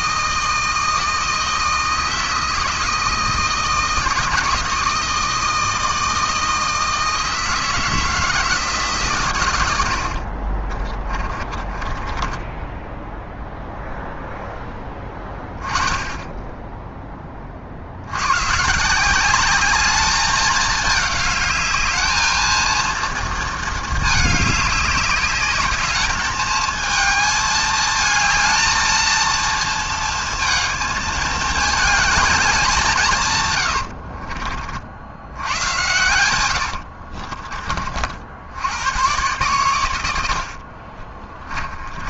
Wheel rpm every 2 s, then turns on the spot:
160, 160, 160, 160, 160, 40, 10, 10, 10, 130, 210, 220, 210, 220, 220, 220, 200, 50, 100, 90, 50.
10-14 36-38 40-42